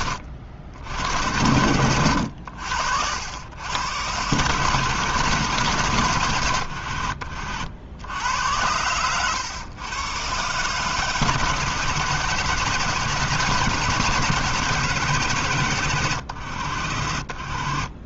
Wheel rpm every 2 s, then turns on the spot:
70, 80, 130, 70, 100, 140, 160, 160, 80.
none